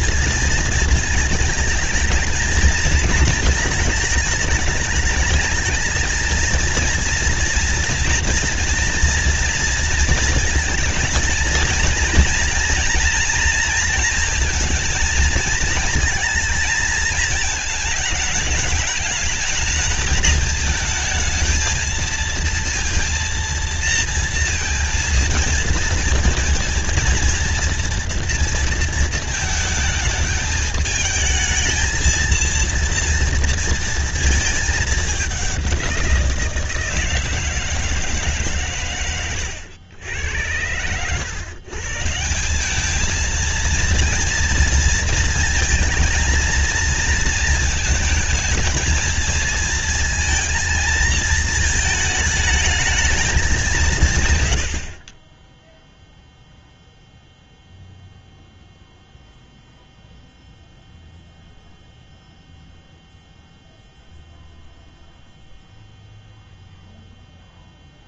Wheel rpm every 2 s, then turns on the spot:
220, 220, 220, 230, 230, 230, 240, 230, 220, 210, 220, 230, 230, 230, 230, 220, 230, 220, 170, 150, 100, 180, 230, 230, 220, 220, 210, 90, 0, 0, 0, 0, 0, 0.
none